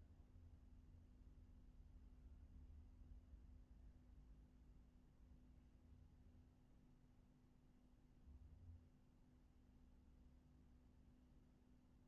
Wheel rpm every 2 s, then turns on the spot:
0, 0, 0, 0, 0, 0.
none